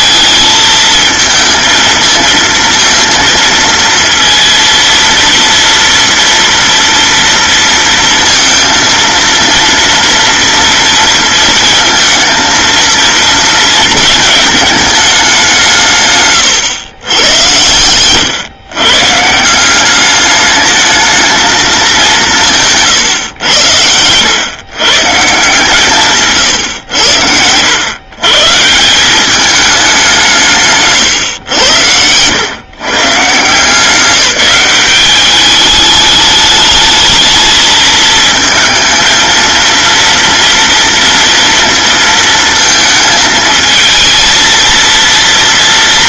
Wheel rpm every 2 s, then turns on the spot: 220, 230, 230, 230, 230, 230, 230, 220, 120, 130, 210, 160, 130, 120, 150, 160, 130, 180, 210, 220, 230, 230, 230.
none